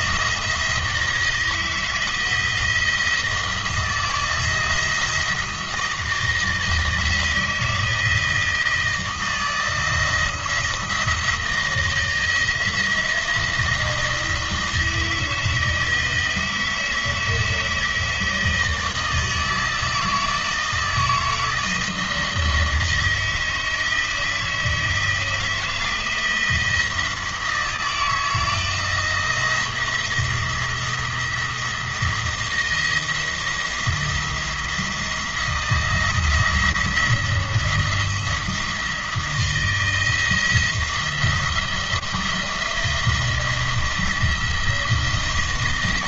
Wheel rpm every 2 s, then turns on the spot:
160, 170, 160, 160, 160, 170, 160, 160, 160, 160, 160, 160, 160, 170, 170, 170, 160, 170, 170, 160, 170, 170, 170.
none